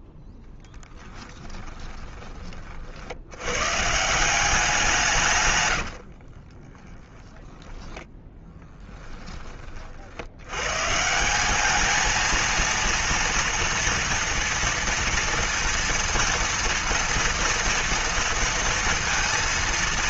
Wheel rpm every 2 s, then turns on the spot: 10, 40, 180, 30, 10, 120, 230, 230, 230, 230.
6-10